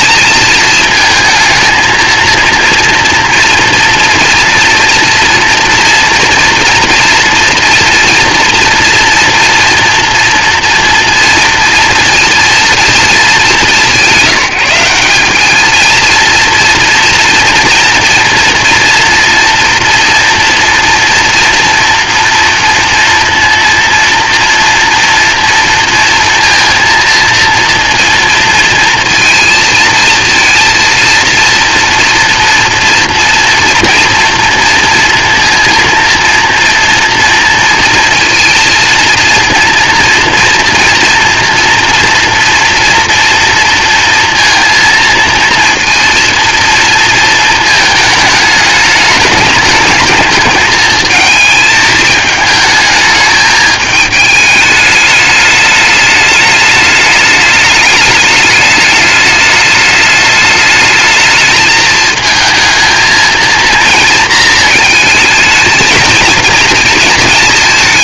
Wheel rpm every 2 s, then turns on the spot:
220, 230, 230, 230, 230, 230, 230, 180, 230, 230, 230, 240, 240, 230, 230, 230, 240, 240, 230, 230, 230, 230, 230, 230, 210, 220, 210, 210, 210, 210, 220, 220, 220, 220.
none